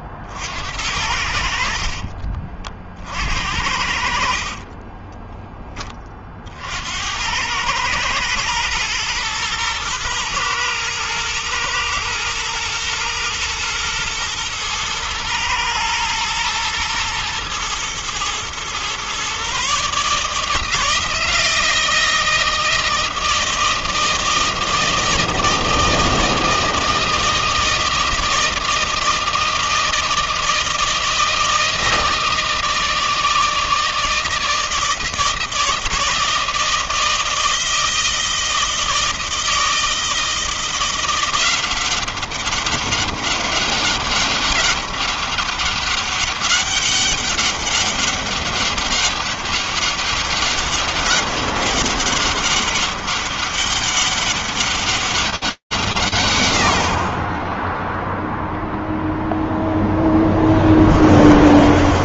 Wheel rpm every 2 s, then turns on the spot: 60, 40, 50, 40, 120, 110, 120, 120, 110, 120, 150, 160, 160, 160, 160, 160, 160, 160, 160, 160, 160, 190, 200, 200, 200, 200, 200, 200, 110, 0, 10.
4-6